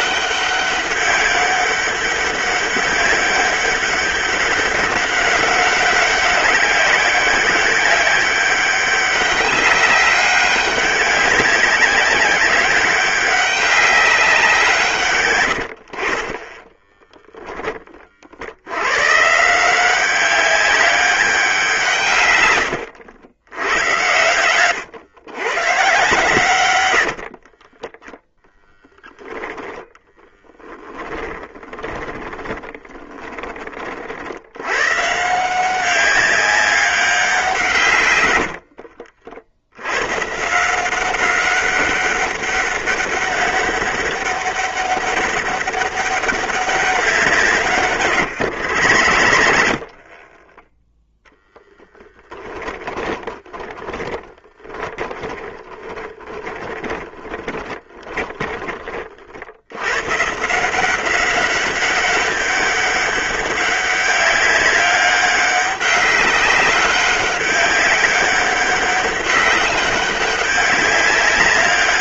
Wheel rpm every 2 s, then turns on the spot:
200, 200, 190, 200, 200, 200, 190, 160, 20, 90, 200, 100, 110, 110, 10, 10, 20, 120, 200, 60, 170, 200, 200, 190, 80, 10, 20, 10, 20, 30, 170, 200, 200, 190, 190, 200.
16-18 26-28 32-34 48-50 52-58